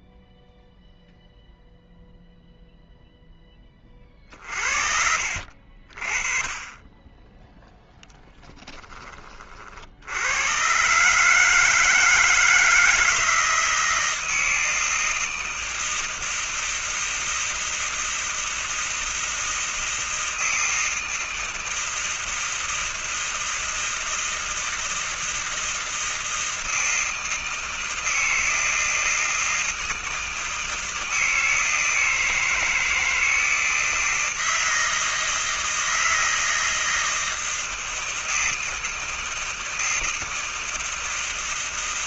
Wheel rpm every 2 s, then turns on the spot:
0, 0, 50, 20, 10, 110, 160, 160, 160, 160, 160, 160, 160, 160, 160, 160, 160, 160, 160, 160, 160.
none